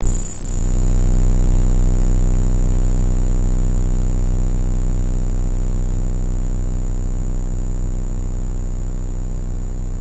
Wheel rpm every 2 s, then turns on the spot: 0, 0, 0, 0, 0.
none